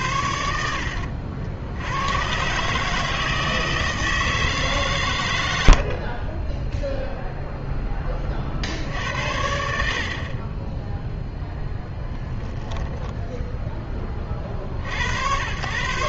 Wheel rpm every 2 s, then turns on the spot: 70, 140, 140, 0, 60, 10, 10, 40.
12-14